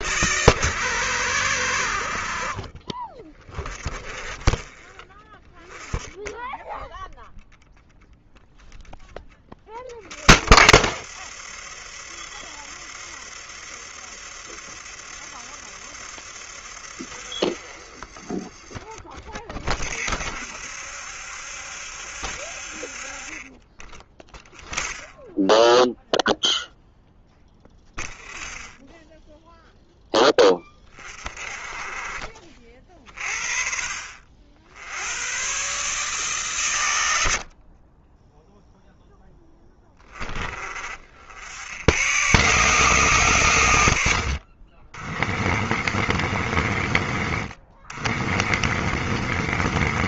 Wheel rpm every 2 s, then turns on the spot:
90, 40, 20, 10, 0, 60, 70, 70, 70, 30, 60, 60, 0, 0, 0, 20, 40, 60, 130, 10, 20, 130, 70, 50, 40.
38-40